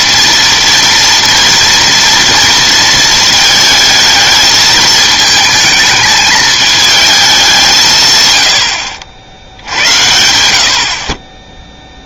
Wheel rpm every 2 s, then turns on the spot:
230, 230, 220, 220, 100, 70.
none